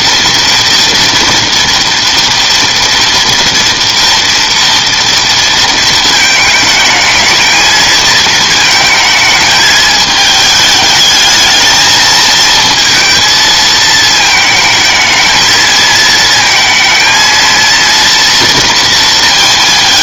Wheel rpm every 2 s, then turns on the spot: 240, 230, 230, 220, 220, 220, 220, 220, 220, 230.
none